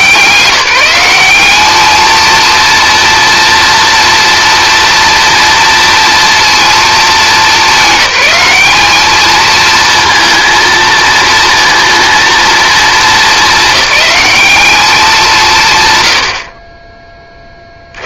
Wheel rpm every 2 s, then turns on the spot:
180, 230, 230, 220, 210, 230, 220, 210, 30.
none